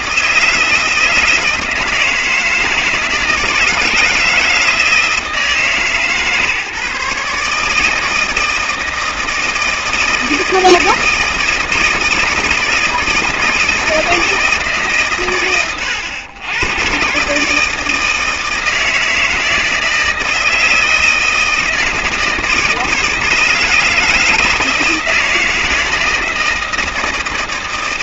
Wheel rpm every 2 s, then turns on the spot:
160, 160, 160, 150, 160, 160, 160, 140, 120, 160, 160, 160, 160, 160.
none